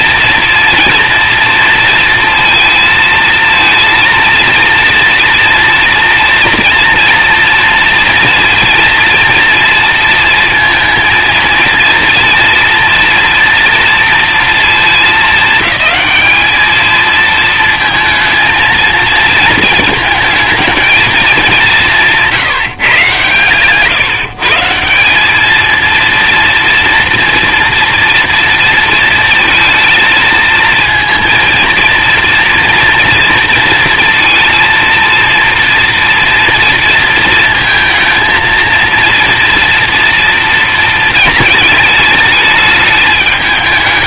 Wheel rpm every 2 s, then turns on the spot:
240, 230, 230, 230, 230, 230, 240, 230, 220, 230, 220, 160, 160, 230, 230, 230, 240, 230, 230, 230, 230, 210.
none